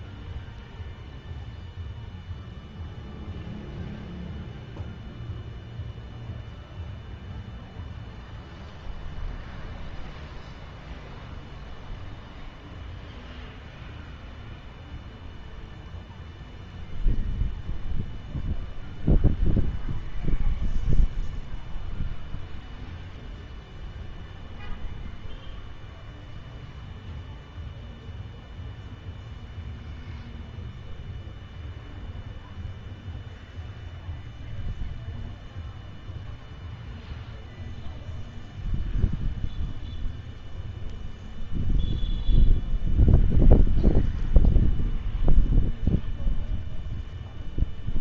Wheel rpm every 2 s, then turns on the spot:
0, 0, 0, 0, 0, 0, 0, 0, 0, 0, 0, 0, 0, 0, 0, 0, 0, 0, 0, 0, 0, 0, 0, 0.
none